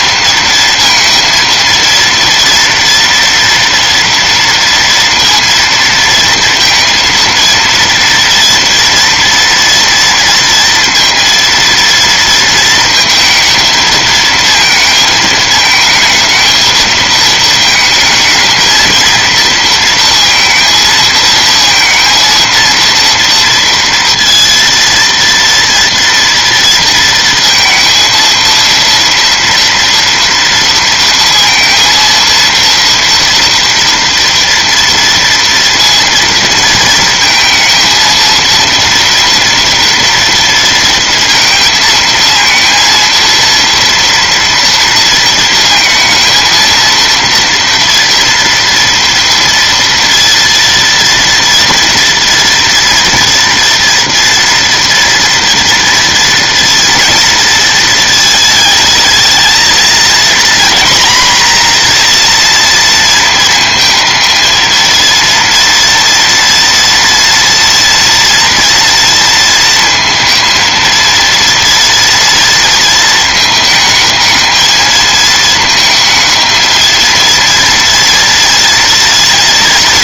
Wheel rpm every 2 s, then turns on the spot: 230, 240, 230, 230, 230, 230, 230, 230, 220, 230, 230, 230, 230, 230, 230, 230, 230, 230, 230, 230, 230, 230, 230, 230, 230, 230, 230, 230, 230, 220, 240, 230, 230, 230, 230, 230, 230, 220, 220, 230.
none